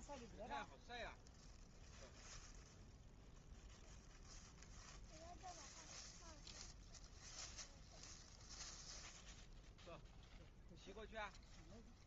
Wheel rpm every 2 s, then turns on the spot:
0, 0, 0, 0, 0, 0.
none